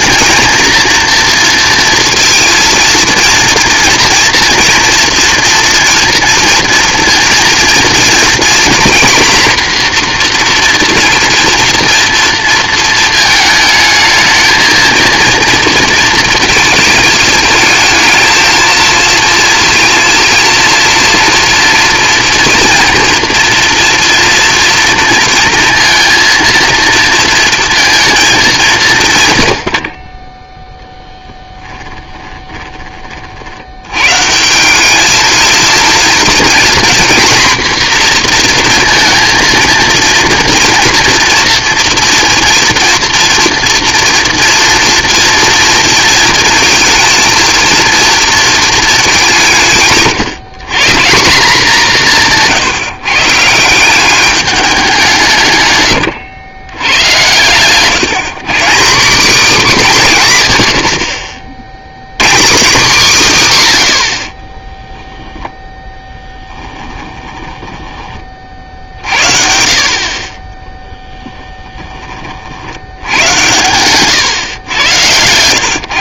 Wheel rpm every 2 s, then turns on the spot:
230, 230, 240, 230, 240, 240, 230, 220, 220, 220, 230, 230, 230, 230, 220, 30, 20, 180, 240, 230, 230, 240, 230, 230, 230, 170, 160, 200, 110, 170, 120, 170, 10, 20, 50, 20, 80, 110.
66-68 70-72